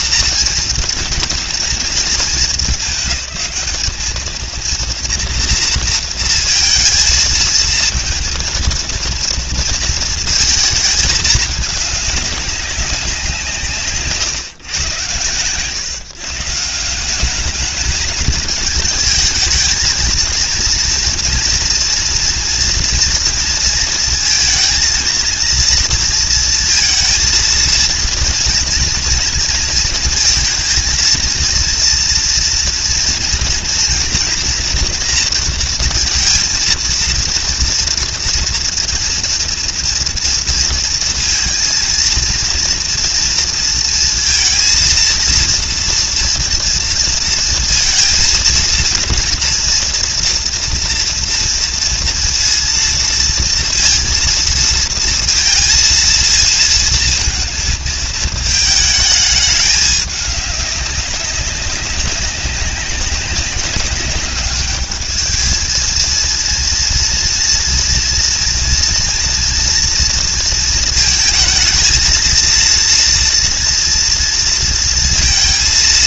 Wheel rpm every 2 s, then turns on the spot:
230, 210, 230, 220, 230, 220, 190, 110, 170, 220, 230, 230, 230, 230, 240, 230, 230, 240, 230, 240, 230, 230, 230, 230, 230, 230, 230, 230, 230, 220, 200, 190, 210, 230, 240, 220, 230, 230.
none